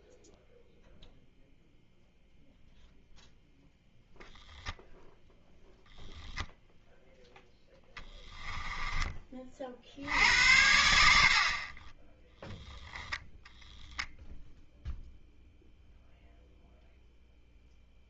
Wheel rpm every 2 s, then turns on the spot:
0, 0, 10, 0, 10, 90, 0, 0, 0.
8-10